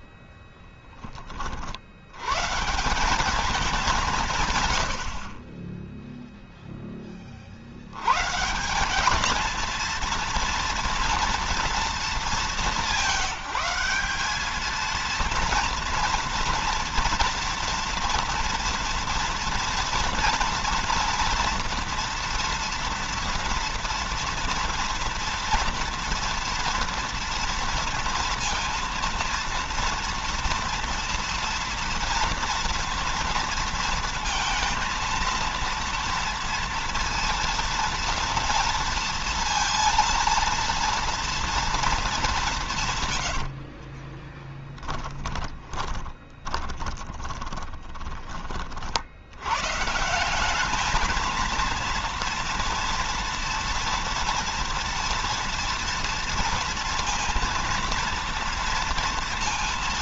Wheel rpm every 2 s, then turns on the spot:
10, 150, 110, 10, 170, 230, 190, 220, 240, 230, 240, 230, 230, 230, 230, 230, 230, 230, 230, 230, 230, 170, 20, 20, 50, 210, 240, 230, 230, 230.
0-2 44-48